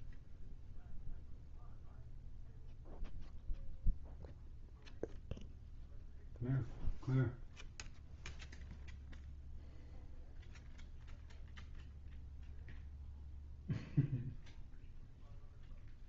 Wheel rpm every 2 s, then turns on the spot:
0, 0, 0, 0, 0, 0, 0, 0.
none